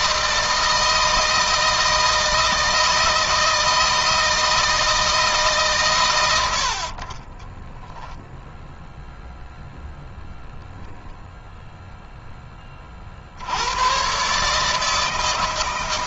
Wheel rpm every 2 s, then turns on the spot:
160, 160, 160, 50, 0, 0, 30, 150.
none